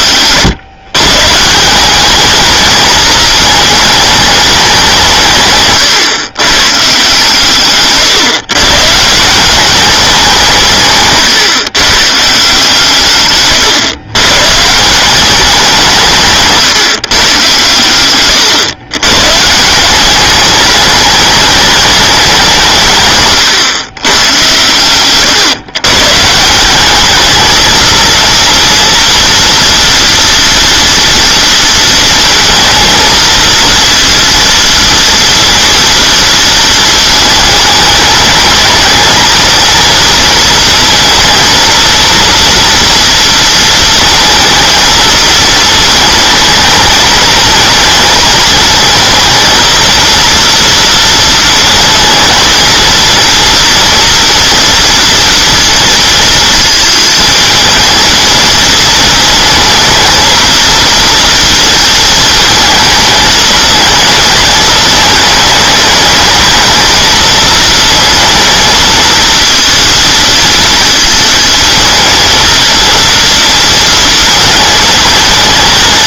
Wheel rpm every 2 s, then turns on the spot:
120, 210, 190, 140, 140, 160, 140, 150, 150, 110, 210, 150, 110, 190, 230, 230, 230, 230, 230, 210, 230, 230, 220, 220, 220, 230, 230, 230, 230, 220, 230, 220, 220, 220, 230, 230, 230, 220.
none